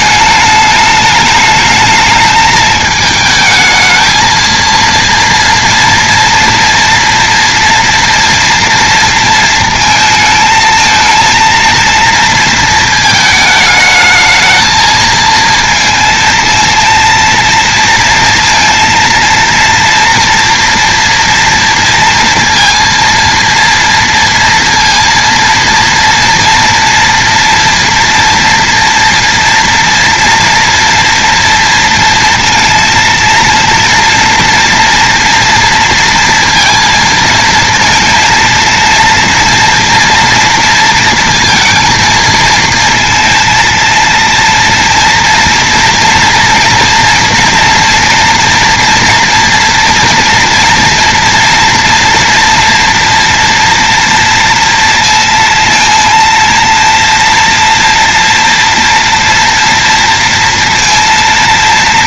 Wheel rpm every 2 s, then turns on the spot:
210, 220, 230, 230, 230, 220, 220, 220, 230, 230, 230, 230, 230, 240, 240, 240, 230, 230, 230, 230, 230, 230, 230, 240, 230, 230, 230, 230, 230, 230, 230.
none